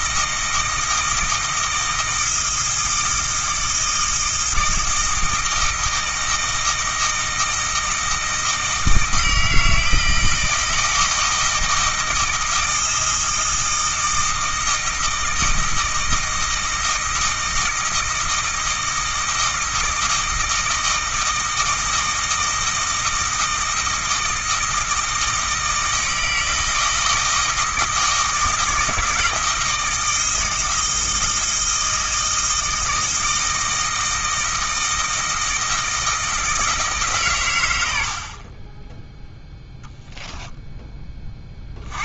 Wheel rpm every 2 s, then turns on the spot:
160, 160, 160, 160, 160, 160, 160, 160, 160, 160, 160, 160, 160, 160, 160, 160, 160, 160, 150, 10, 10.
none